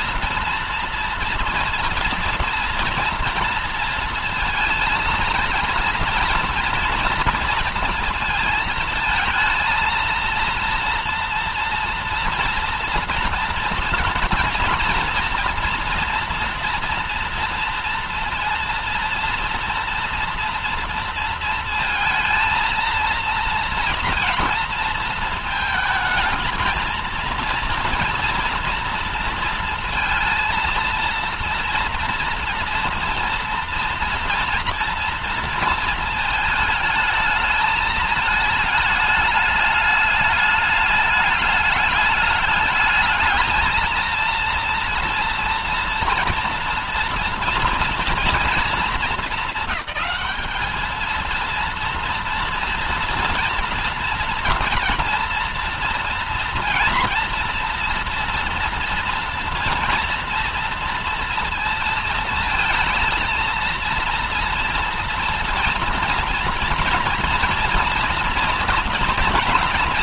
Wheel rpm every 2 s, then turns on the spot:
230, 230, 230, 230, 230, 230, 230, 240, 230, 230, 230, 230, 230, 230, 230, 230, 230, 230, 220, 220, 210, 210, 230, 230, 230, 220, 230, 230, 230, 230, 230, 220, 230, 230, 230.
none